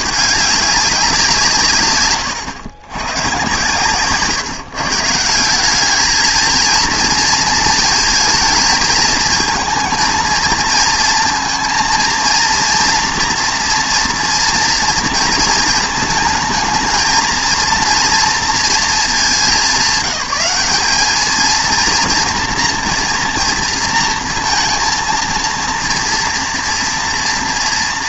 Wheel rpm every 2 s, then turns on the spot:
200, 100, 140, 230, 220, 230, 230, 230, 220, 230, 190, 240, 230, 240.
none